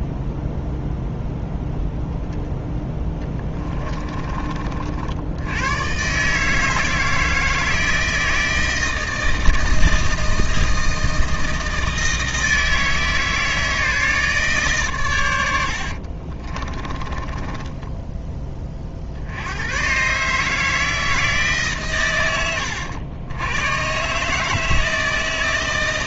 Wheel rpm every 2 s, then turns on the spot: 0, 10, 50, 160, 160, 160, 160, 120, 20, 40, 160, 100, 160.
16-18